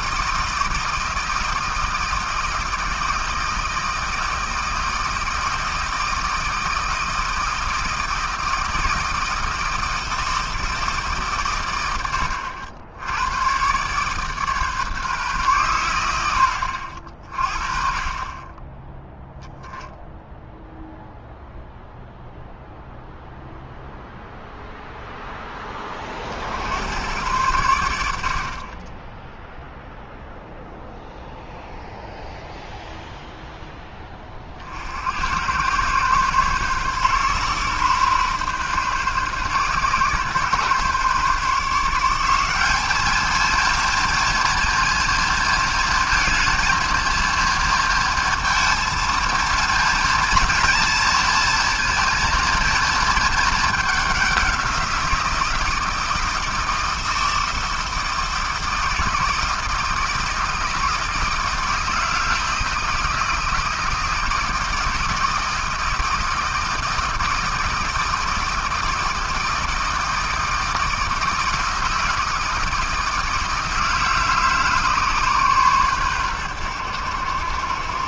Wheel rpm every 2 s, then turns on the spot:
160, 160, 160, 160, 160, 150, 80, 150, 60, 10, 0, 0, 0, 90, 20, 0, 0, 60, 130, 130, 130, 210, 230, 230, 230, 230, 220, 180, 160, 160, 160, 160, 160, 160, 160, 160, 160, 150, 90.
none